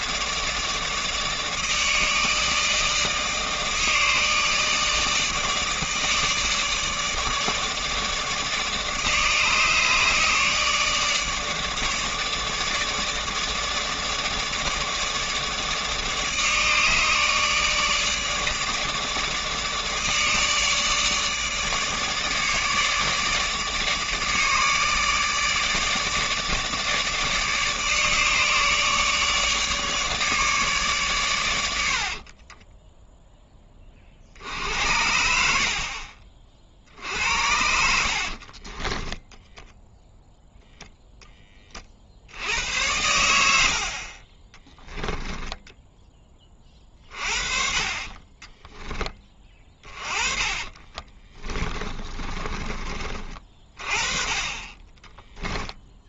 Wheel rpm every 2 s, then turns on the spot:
150, 150, 150, 150, 150, 150, 150, 150, 150, 150, 150, 150, 150, 150, 150, 140, 10, 70, 50, 30, 0, 100, 10, 30, 10, 30, 40, 20.
38-40 44-46 50-52